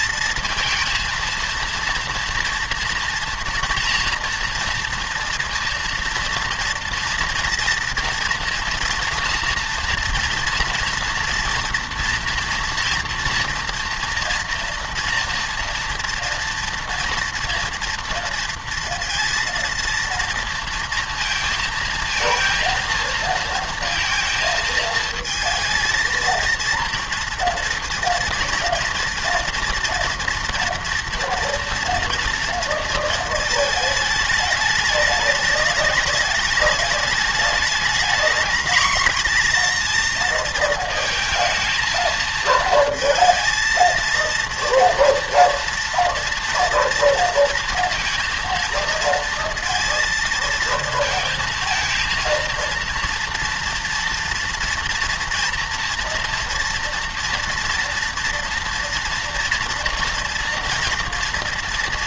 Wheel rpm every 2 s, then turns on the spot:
230, 230, 230, 230, 230, 230, 230, 230, 230, 230, 230, 230, 220, 230, 230, 230, 230, 210, 210, 230, 230, 220, 230, 230, 230, 220, 230, 240, 230, 230, 230.
none